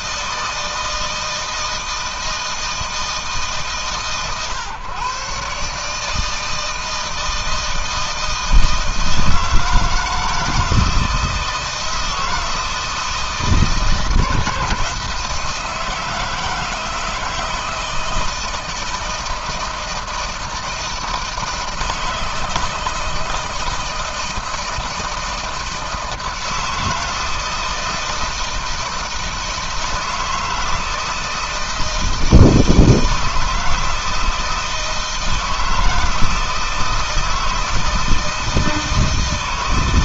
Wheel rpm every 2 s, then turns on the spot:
160, 160, 130, 160, 160, 160, 160, 160, 160, 160, 160, 160, 160, 160, 160, 160, 160, 160, 160, 160.
none